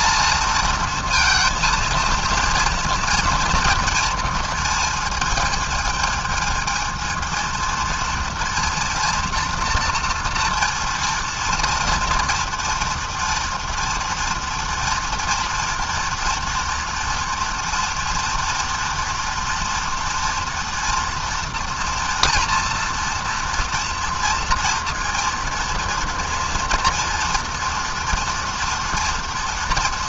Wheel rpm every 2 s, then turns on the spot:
230, 230, 220, 230, 230, 230, 230, 230, 240, 240, 230, 230, 230, 240, 230.
none